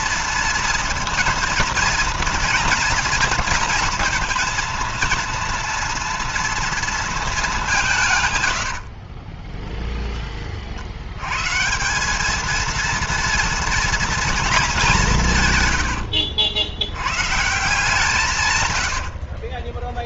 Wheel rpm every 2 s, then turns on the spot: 230, 230, 230, 230, 110, 30, 210, 220, 80, 140.
8-10 18-20